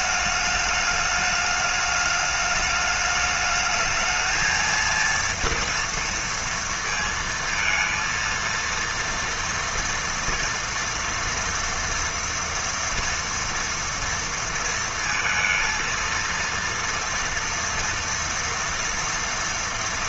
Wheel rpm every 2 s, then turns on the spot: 210, 210, 230, 230, 230, 230, 230, 230, 230, 230.
none